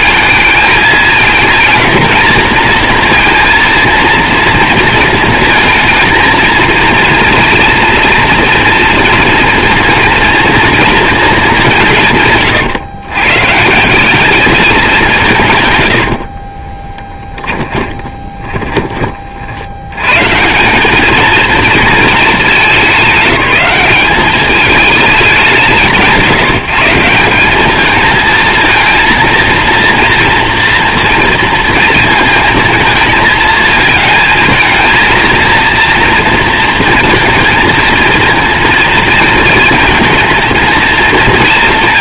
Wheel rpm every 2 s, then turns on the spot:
220, 230, 220, 230, 230, 220, 130, 180, 10, 30, 210, 200, 200, 180, 230, 240, 220, 220, 230, 230, 230.
16-18